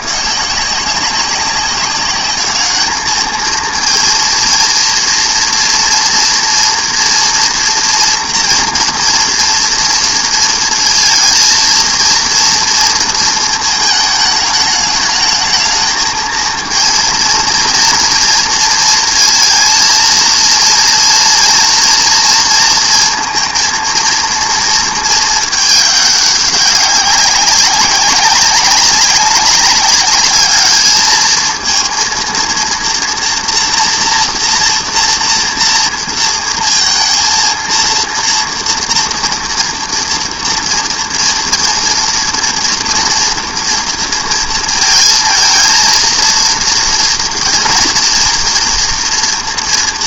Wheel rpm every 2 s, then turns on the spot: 170, 210, 230, 230, 230, 230, 230, 210, 230, 230, 230, 230, 230, 200, 190, 210, 230, 240, 230, 230, 230, 230, 230, 230, 230.
none